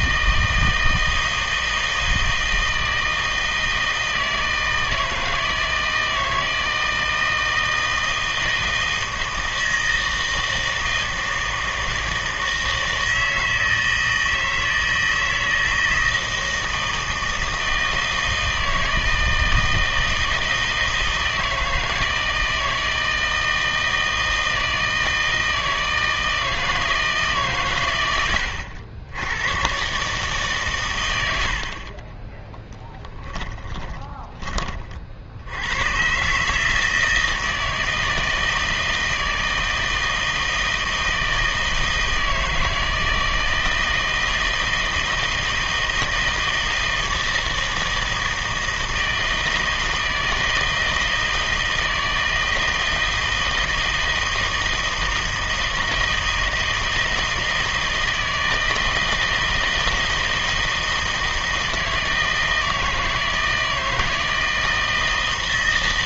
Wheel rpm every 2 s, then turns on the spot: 160, 160, 160, 160, 160, 160, 160, 160, 160, 160, 160, 160, 160, 160, 90, 130, 20, 30, 150, 160, 160, 160, 160, 160, 160, 160, 160, 160, 160, 160, 160, 160, 160.
32-34